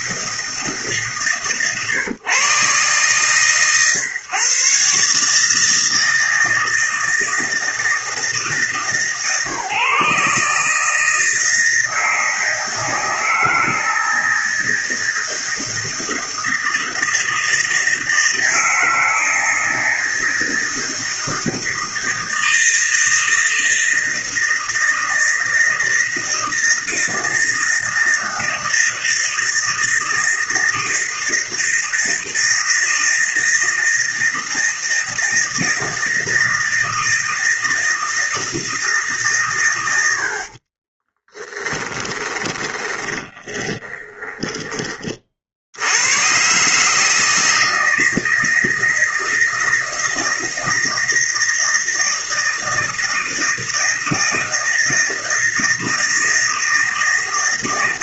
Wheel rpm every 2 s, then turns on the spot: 150, 130, 140, 160, 150, 150, 160, 170, 160, 160, 160, 160, 160, 160, 160, 160, 160, 160, 160, 160, 40, 20, 20, 140, 160, 160, 160, 160, 160.
40-44